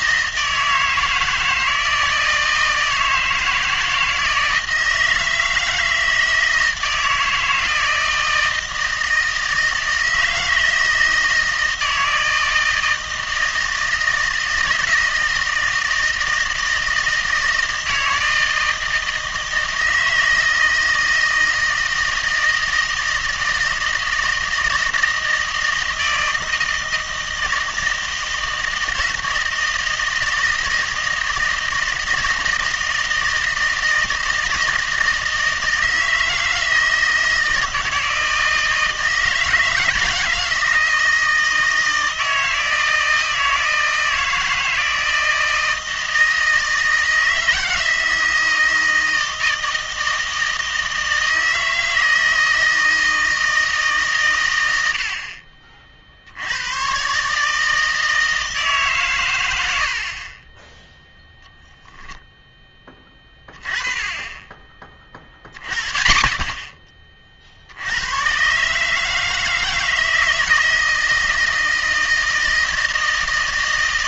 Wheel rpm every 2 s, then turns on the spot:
160, 160, 160, 160, 160, 160, 160, 160, 160, 160, 160, 160, 160, 160, 160, 160, 160, 160, 160, 160, 160, 160, 160, 160, 160, 160, 160, 80, 110, 140, 10, 10, 30, 30, 140, 160, 160.
none